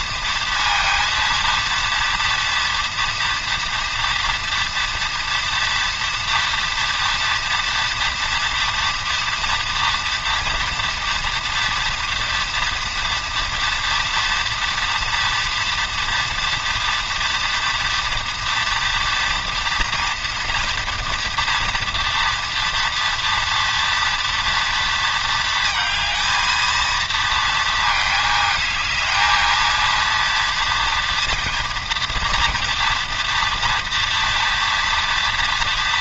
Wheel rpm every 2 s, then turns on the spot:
230, 230, 230, 230, 230, 230, 240, 230, 230, 230, 240, 230, 230, 220, 220, 230, 230, 230.
none